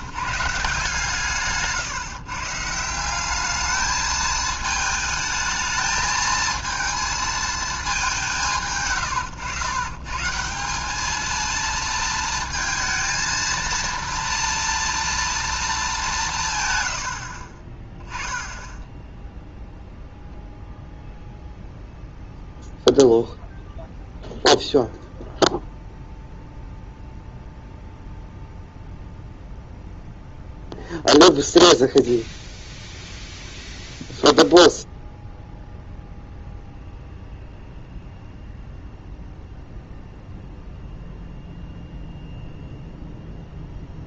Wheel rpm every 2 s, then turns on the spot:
160, 160, 220, 220, 140, 190, 230, 230, 140, 10, 0, 0, 0, 0, 0, 0, 0, 0, 0, 0, 0, 0.
none